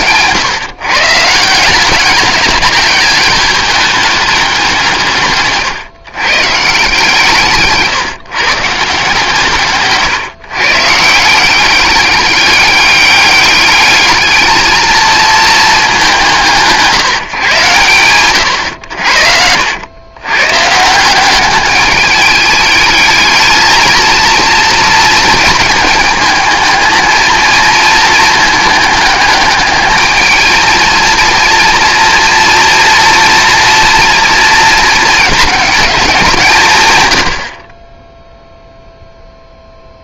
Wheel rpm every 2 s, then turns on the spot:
140, 200, 180, 150, 150, 150, 200, 220, 160, 90, 150, 210, 230, 220, 210, 220, 240, 230, 120, 0.
none